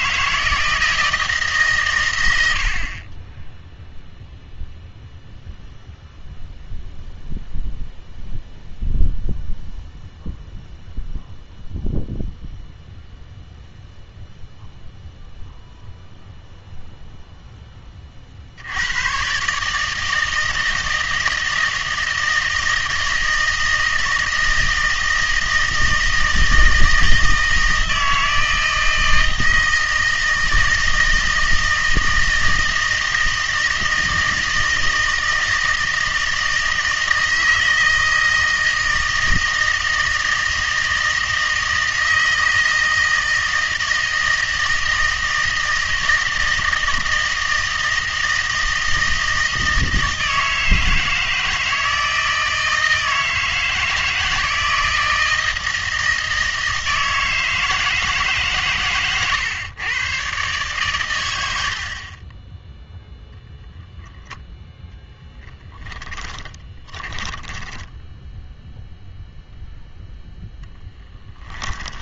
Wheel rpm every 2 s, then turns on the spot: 160, 70, 0, 0, 0, 0, 0, 0, 0, 80, 160, 160, 160, 160, 160, 160, 160, 160, 160, 160, 160, 160, 160, 160, 160, 160, 160, 160, 160, 140, 120, 10, 10, 20, 0, 10.
66-68